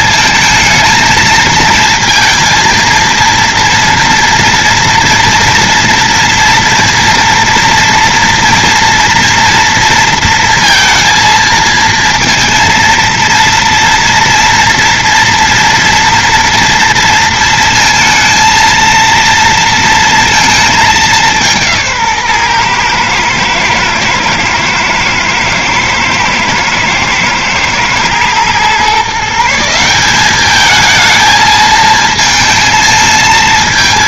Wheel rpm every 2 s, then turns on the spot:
220, 230, 230, 230, 230, 230, 230, 230, 230, 230, 210, 120, 120, 110, 130, 220, 220.
none